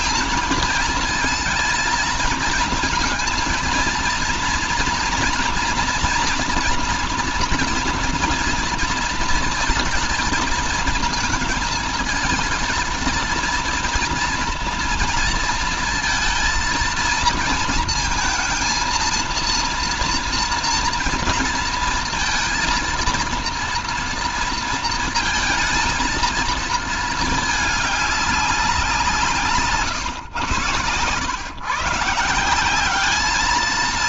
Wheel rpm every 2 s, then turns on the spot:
230, 230, 230, 230, 230, 220, 230, 230, 230, 230, 230, 230, 230, 220, 180, 130, 190.
none